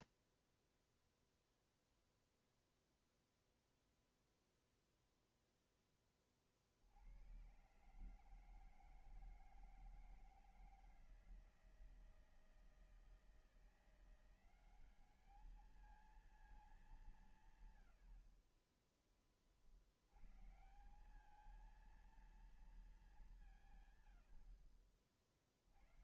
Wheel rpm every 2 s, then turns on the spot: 0, 0, 0, 40, 160, 170, 160, 180, 210, 50, 120, 230, 80.
none